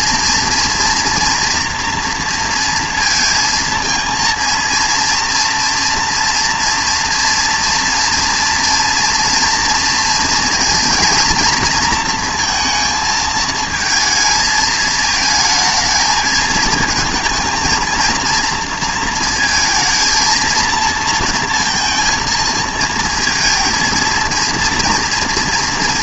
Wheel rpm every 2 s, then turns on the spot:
230, 230, 230, 230, 240, 230, 230, 220, 220, 230, 230, 230, 230.
none